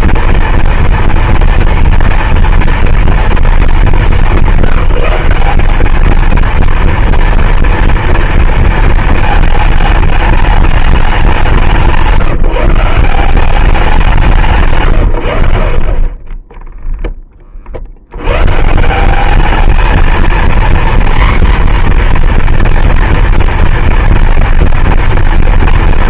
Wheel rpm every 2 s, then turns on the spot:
240, 230, 200, 230, 230, 210, 160, 170, 10, 120, 240, 240, 230.
none